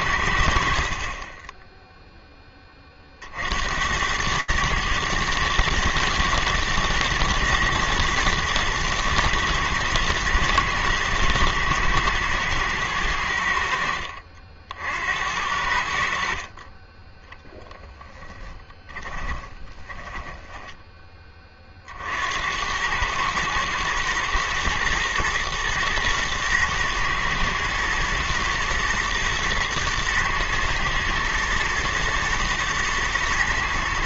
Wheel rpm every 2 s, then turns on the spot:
70, 20, 110, 110, 110, 120, 110, 70, 30, 20, 20, 100, 120, 120, 110, 110, 110.
18-20